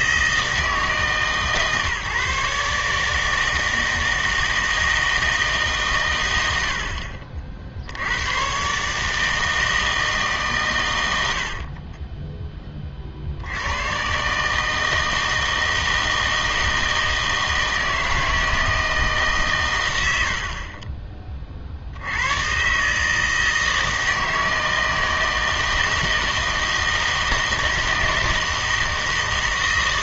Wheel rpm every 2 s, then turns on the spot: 160, 140, 160, 70, 130, 120, 30, 160, 160, 160, 40, 140, 160, 160, 160.
none